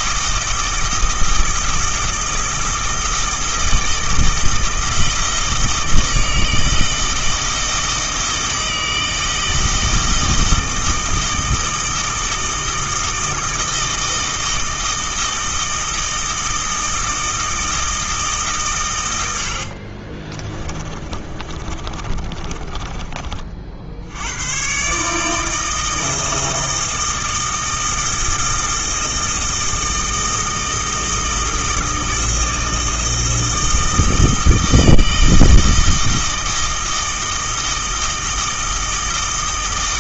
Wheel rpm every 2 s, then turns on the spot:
160, 160, 160, 160, 160, 160, 160, 160, 160, 130, 20, 30, 140, 160, 160, 160, 160, 160, 160, 160.
20-24